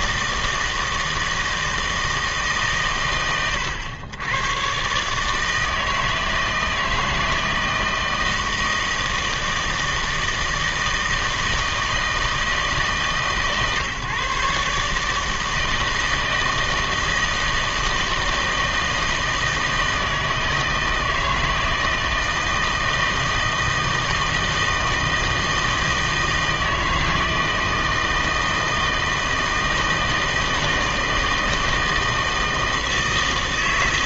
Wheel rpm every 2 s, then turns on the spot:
160, 130, 120, 160, 160, 160, 150, 140, 160, 160, 160, 160, 160, 160, 160, 160, 160.
none